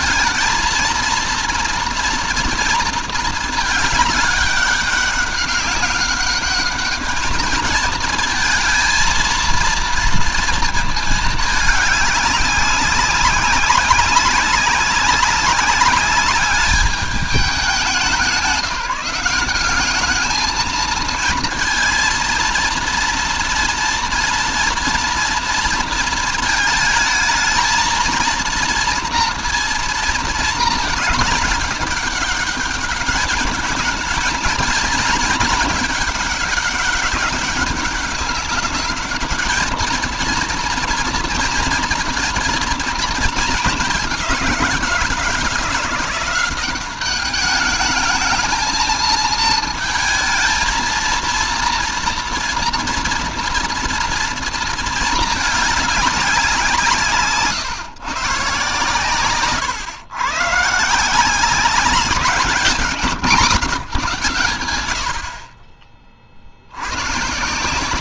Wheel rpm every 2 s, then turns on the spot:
220, 230, 200, 210, 220, 230, 190, 190, 200, 180, 220, 230, 230, 220, 230, 220, 200, 220, 200, 210, 230, 230, 180, 190, 220, 220, 230, 230, 170, 130, 150, 190, 100, 80.
none